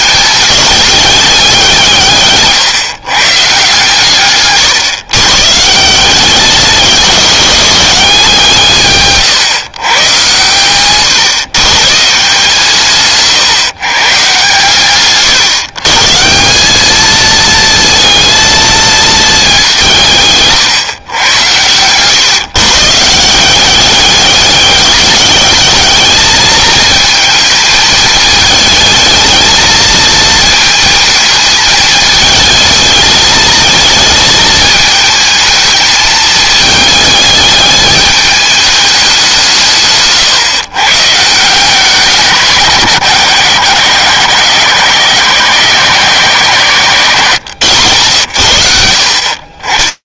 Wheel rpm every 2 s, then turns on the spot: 210, 140, 140, 210, 150, 110, 150, 140, 200, 230, 130, 150, 200, 220, 220, 230, 220, 220, 220, 210, 130, 160, 140, 140, 70.
none